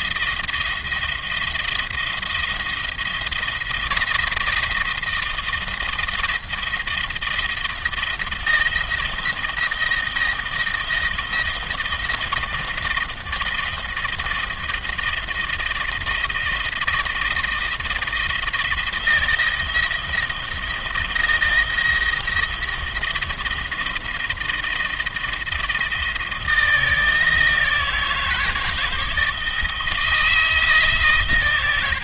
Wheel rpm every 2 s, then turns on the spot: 170, 170, 160, 170, 170, 160, 170, 160, 160, 170, 170, 170, 160, 160, 160, 150.
none